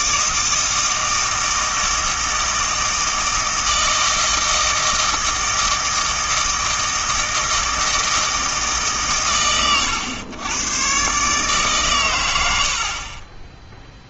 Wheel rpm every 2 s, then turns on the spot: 160, 160, 160, 160, 150, 120, 80.
none